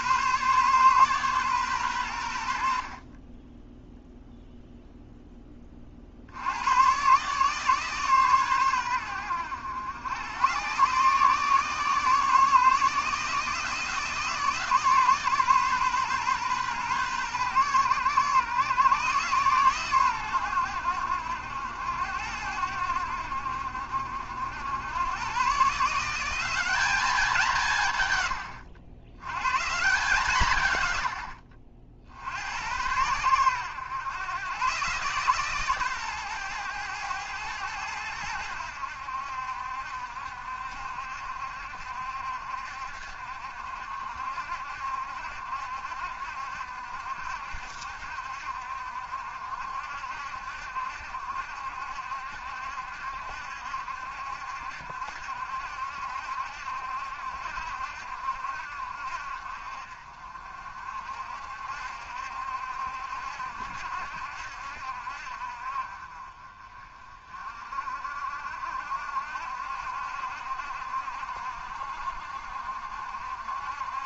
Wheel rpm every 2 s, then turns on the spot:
130, 60, 0, 90, 110, 120, 150, 150, 130, 130, 100, 90, 100, 200, 90, 120, 90, 130, 110, 80, 70, 60, 70, 70, 70, 70, 70, 70, 70, 60, 50, 70, 70, 30, 60, 70, 60.
none